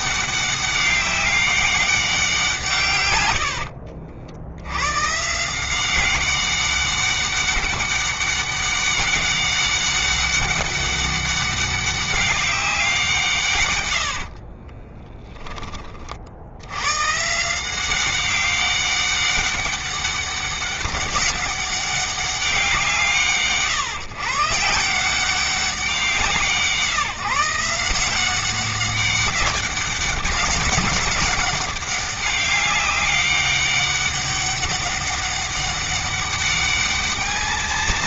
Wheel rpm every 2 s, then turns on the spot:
200, 110, 140, 200, 200, 200, 160, 20, 150, 200, 200, 160, 180, 160, 200, 200, 200, 200, 220.
2-4 14-16